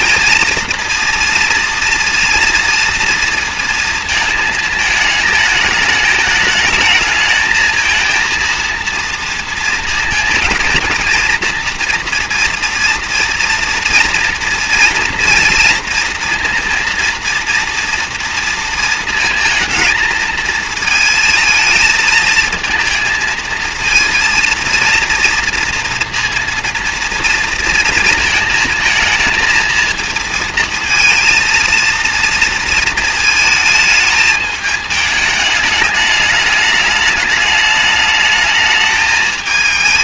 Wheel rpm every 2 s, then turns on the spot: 230, 230, 230, 220, 230, 230, 230, 230, 230, 230, 220, 230, 230, 230, 220, 230, 230, 220, 210, 220.
none